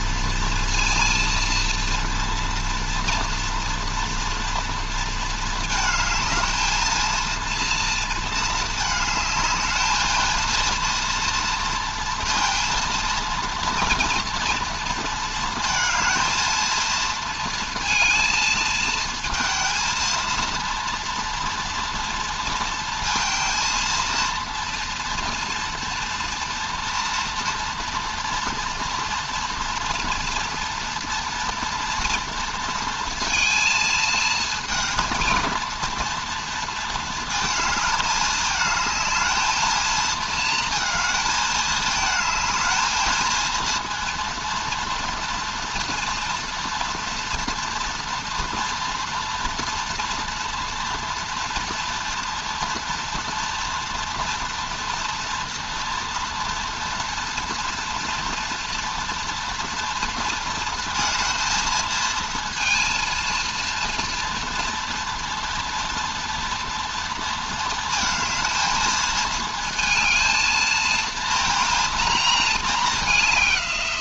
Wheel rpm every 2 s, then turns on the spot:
230, 240, 230, 220, 220, 230, 230, 230, 230, 230, 230, 230, 230, 240, 240, 240, 230, 230, 230, 220, 220, 220, 230, 230, 230, 230, 230, 230, 230, 240, 230, 230, 240, 230, 220, 230, 210.
none